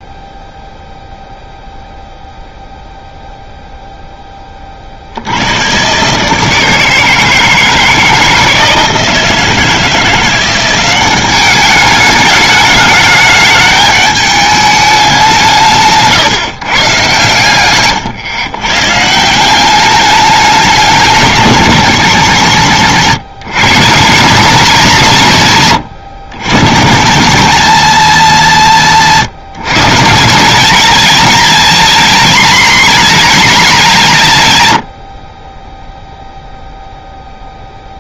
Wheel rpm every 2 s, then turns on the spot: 0, 0, 30, 160, 160, 180, 210, 210, 140, 130, 210, 160, 190, 140, 190, 210, 230, 120, 0.
none